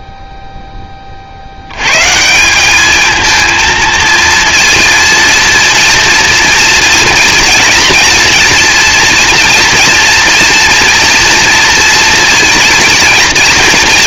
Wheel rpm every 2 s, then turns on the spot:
0, 190, 230, 230, 240, 230, 230.
none